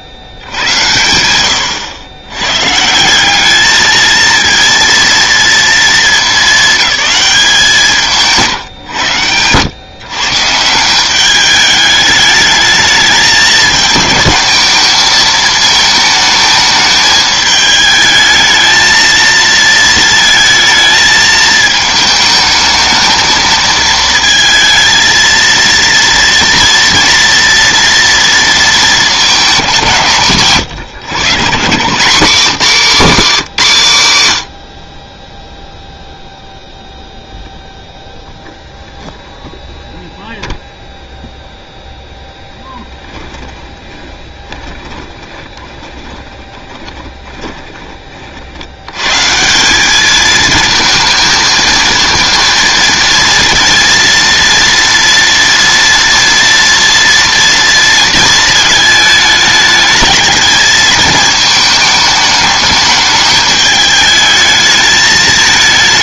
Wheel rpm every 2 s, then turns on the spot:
60, 130, 230, 210, 130, 150, 210, 220, 220, 220, 220, 220, 230, 230, 230, 160, 220, 80, 0, 0, 0, 10, 10, 20, 70, 220, 230, 230, 230, 220, 220, 210, 220.
32-34 44-48